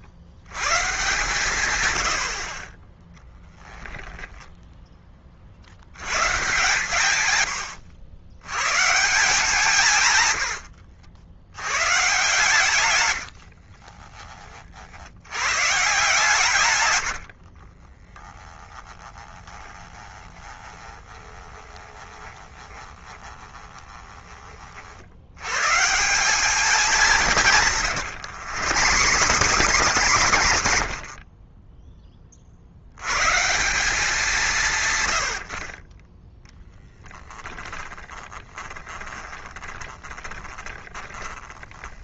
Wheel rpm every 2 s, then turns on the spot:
120, 20, 10, 140, 140, 80, 120, 40, 140, 20, 20, 20, 40, 200, 120, 80, 60, 170, 10, 10, 20.
18-24 28-32 38-42